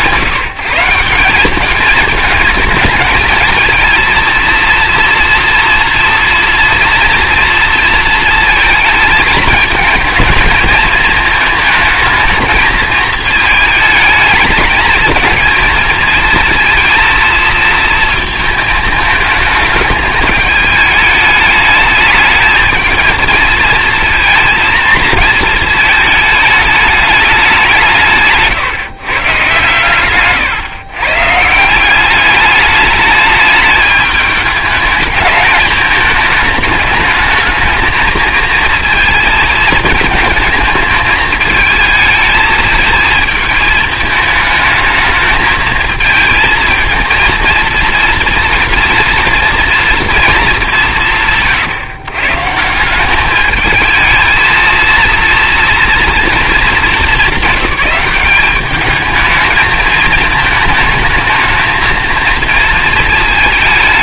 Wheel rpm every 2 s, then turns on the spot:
170, 220, 230, 230, 230, 220, 210, 220, 230, 220, 210, 220, 230, 210, 160, 130, 210, 210, 220, 220, 220, 220, 210, 220, 230, 210, 150, 230, 220, 210, 220, 220.
none